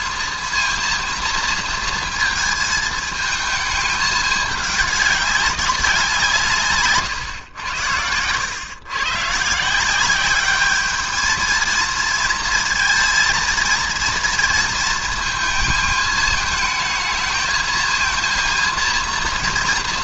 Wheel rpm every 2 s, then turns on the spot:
230, 220, 210, 150, 110, 210, 230, 230, 220, 230.
none